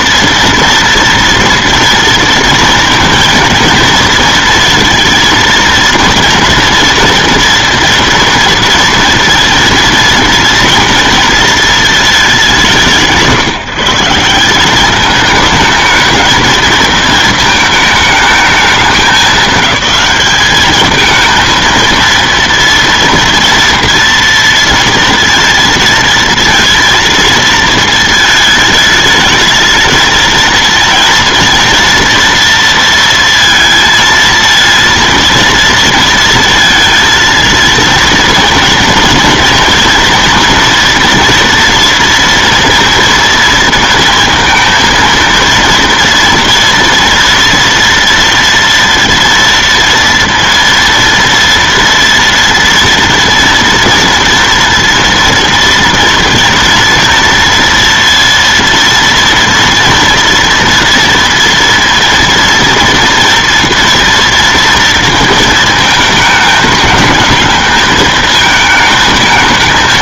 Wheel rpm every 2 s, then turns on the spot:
230, 230, 230, 230, 230, 230, 190, 200, 220, 200, 210, 230, 230, 230, 210, 230, 230, 230, 230, 240, 230, 230, 230, 240, 230, 230, 230, 230, 230, 230, 230, 230, 230, 220, 220.
none